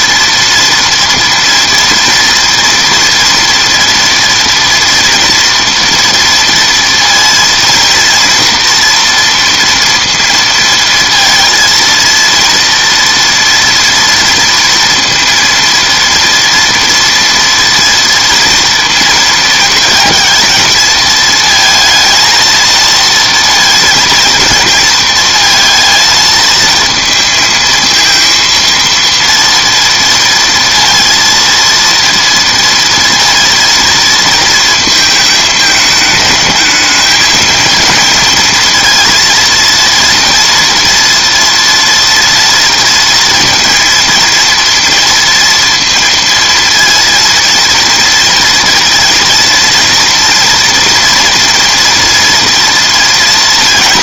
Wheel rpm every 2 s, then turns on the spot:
230, 230, 230, 230, 230, 230, 230, 230, 230, 230, 230, 230, 230, 230, 230, 230, 230, 230, 210, 230, 240, 230, 230, 230, 230, 230, 240.
none